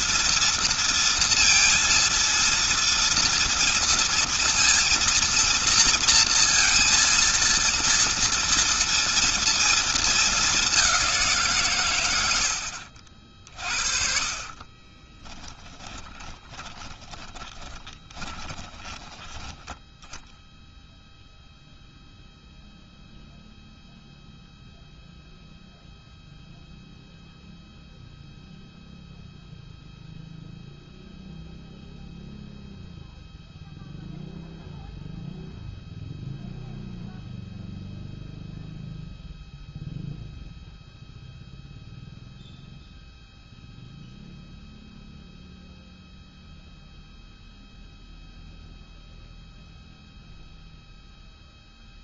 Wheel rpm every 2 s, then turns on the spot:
230, 230, 230, 230, 230, 210, 80, 20, 10, 20, 0, 0, 0, 0, 0, 0, 0, 0, 0, 0, 0, 0, 0, 0, 0, 0.
12-20